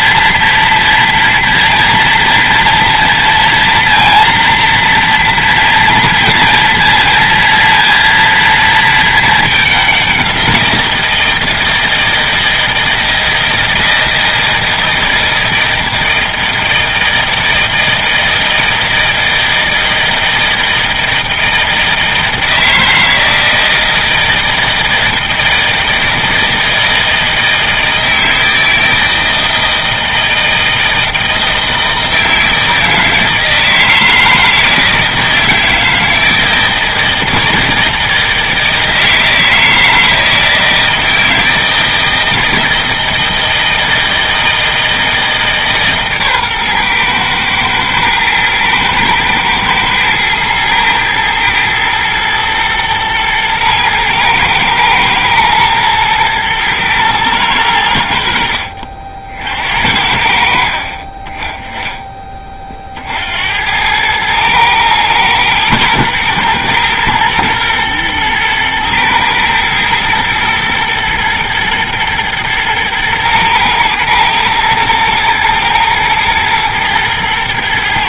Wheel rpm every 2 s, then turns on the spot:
240, 230, 230, 230, 220, 170, 160, 160, 160, 160, 160, 160, 160, 160, 160, 160, 160, 160, 160, 160, 160, 160, 160, 120, 110, 110, 110, 120, 110, 60, 40, 40, 110, 110, 110, 120, 110, 110, 110.
none